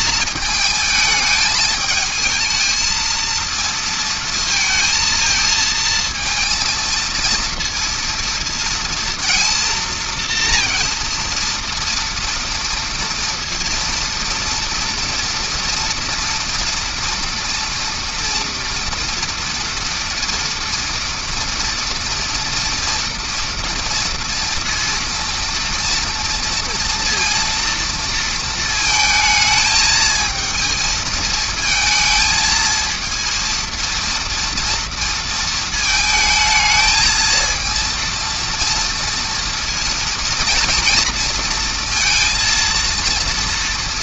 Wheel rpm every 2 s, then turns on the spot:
220, 220, 230, 230, 230, 230, 230, 230, 230, 230, 240, 230, 230, 230, 220, 220, 220, 230, 220, 230, 230, 230.
none